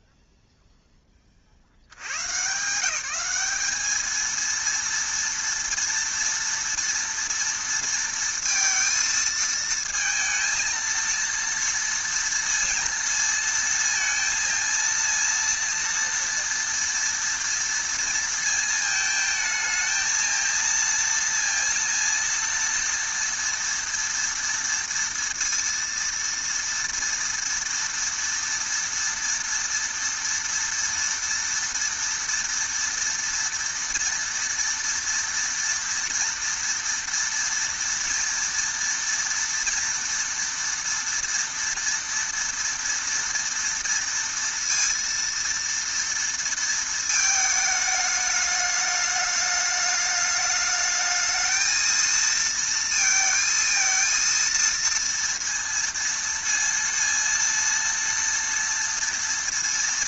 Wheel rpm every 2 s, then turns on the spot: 0, 160, 230, 230, 230, 230, 230, 230, 230, 230, 230, 230, 230, 230, 230, 230, 230, 230, 230, 230, 240, 230, 230, 230, 210, 210, 230, 230, 230, 230.
none